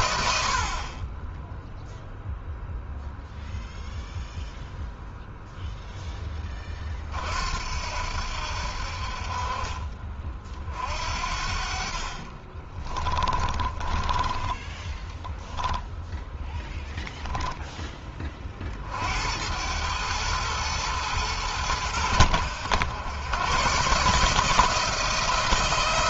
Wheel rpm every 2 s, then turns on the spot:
50, 0, 0, 30, 70, 50, 30, 10, 0, 40, 110, 90, 160.
12-16